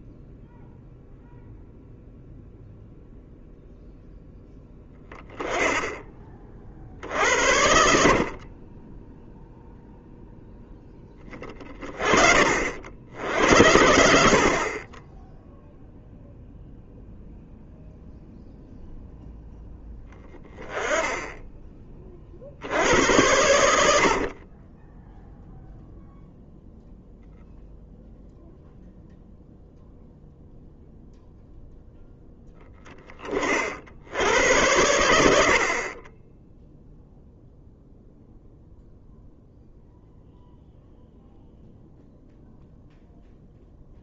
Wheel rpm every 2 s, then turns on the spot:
0, 0, 10, 60, 20, 10, 70, 40, 0, 0, 10, 80, 10, 0, 0, 0, 10, 90, 0, 0, 0, 0.
8-10 24-26